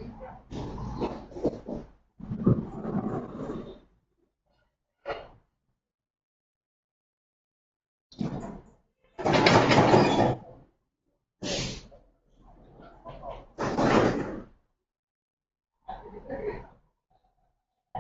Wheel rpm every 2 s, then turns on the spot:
0, 0, 0, 0, 0, 0, 0, 0, 0.
none